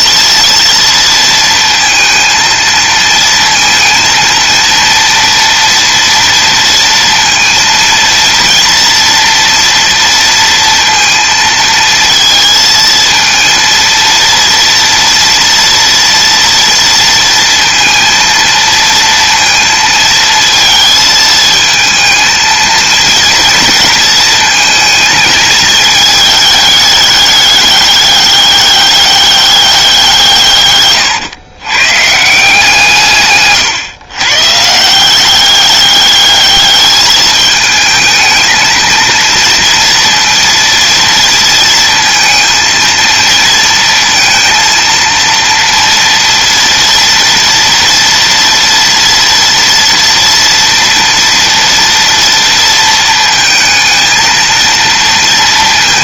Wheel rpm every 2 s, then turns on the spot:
230, 230, 230, 230, 230, 230, 230, 230, 230, 230, 220, 230, 220, 210, 200, 120, 150, 180, 220, 230, 230, 230, 230, 230, 230, 230, 230, 230.
none